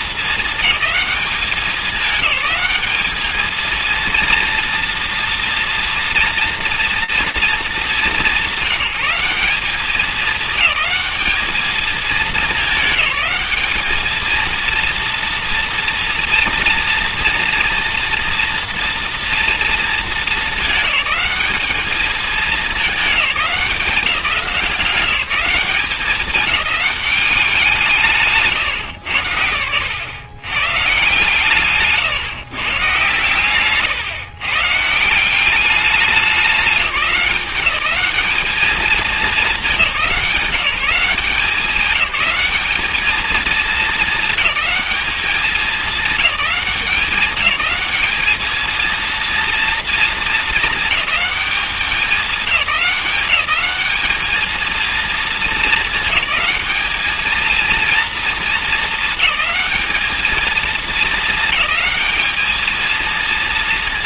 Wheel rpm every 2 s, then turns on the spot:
210, 200, 230, 230, 190, 210, 210, 230, 230, 240, 220, 210, 180, 200, 120, 140, 140, 160, 190, 210, 180, 210, 220, 200, 230, 220, 200, 230, 210, 220, 220, 220.
none